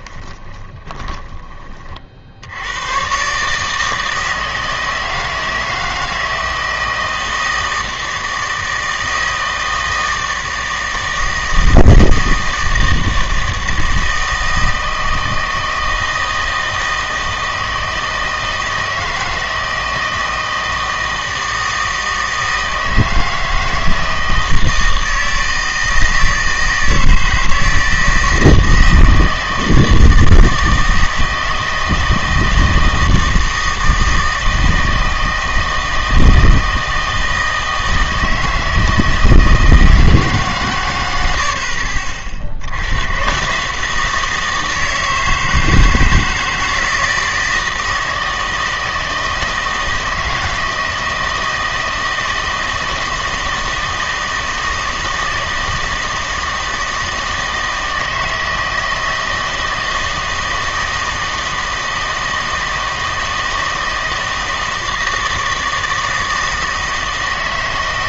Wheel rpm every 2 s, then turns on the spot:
20, 100, 160, 160, 160, 160, 160, 160, 160, 160, 160, 160, 160, 160, 160, 160, 160, 160, 160, 160, 120, 80, 160, 160, 160, 160, 160, 160, 160, 160, 160, 160, 160, 160.
0-2